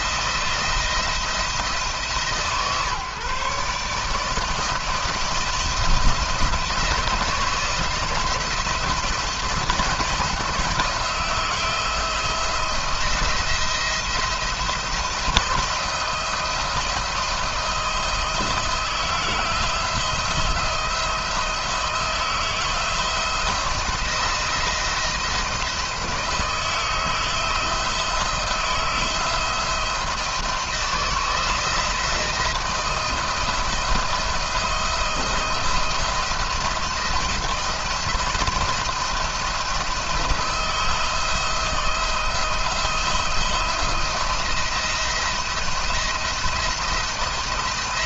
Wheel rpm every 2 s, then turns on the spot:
170, 150, 170, 170, 170, 170, 160, 170, 160, 160, 170, 170, 170, 160, 170, 170, 170, 170, 170, 170, 170, 170, 170, 170.
none